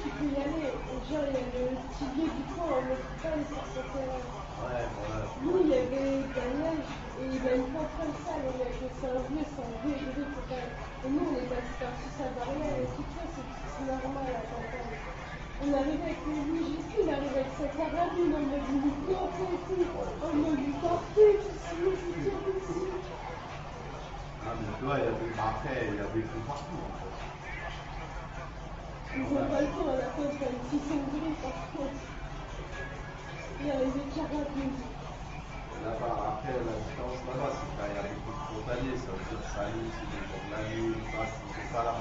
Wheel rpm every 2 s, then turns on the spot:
0, 0, 0, 0, 0, 0, 0, 0, 0, 0, 0, 0, 0, 0, 0, 0, 0, 0, 0, 0, 0.
none